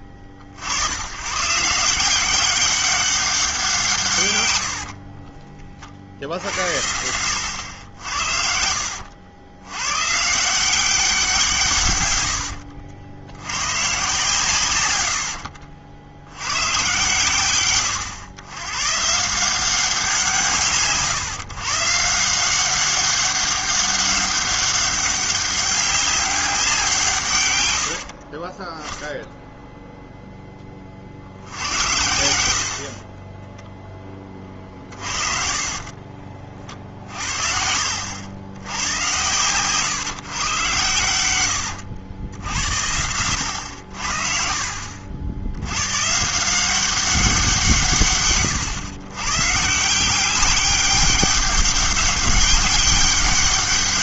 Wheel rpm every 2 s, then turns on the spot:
70, 190, 80, 80, 70, 180, 70, 120, 110, 110, 150, 180, 200, 180, 20, 10, 60, 40, 50, 90, 120, 90, 50, 180, 130, 200, 200.
4-6 12-14 34-36 44-46